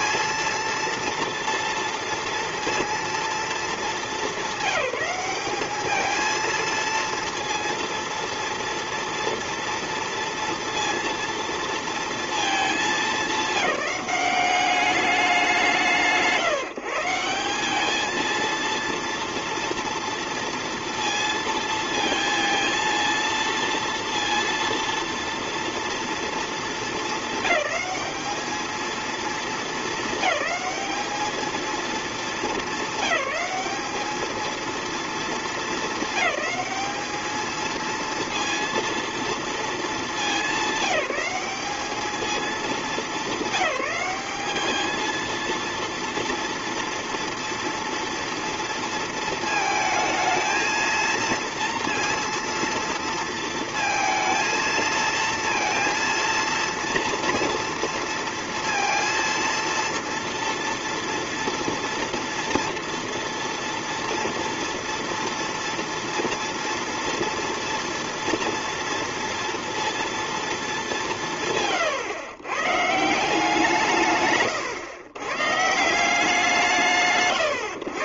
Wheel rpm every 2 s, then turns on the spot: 230, 230, 200, 230, 230, 230, 220, 190, 150, 230, 230, 230, 230, 220, 220, 210, 200, 230, 210, 230, 210, 210, 210, 230, 230, 230, 230, 230, 230, 230, 230, 230, 230, 230, 230, 220, 150, 130, 150.
none